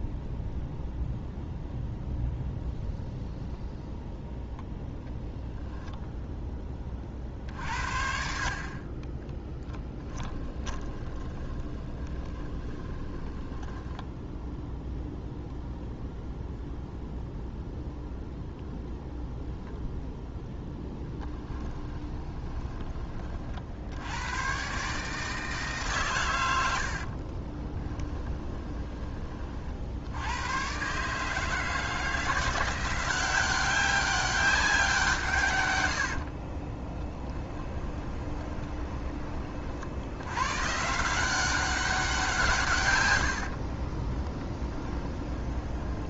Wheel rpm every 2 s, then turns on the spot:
0, 0, 10, 20, 40, 20, 20, 0, 0, 0, 0, 20, 140, 80, 20, 130, 170, 190, 20, 20, 140, 140, 10.
10-14 28-30 36-40 44-46